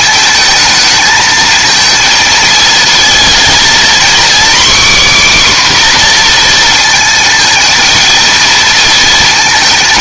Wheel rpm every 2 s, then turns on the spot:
220, 230, 270, 240, 230.
none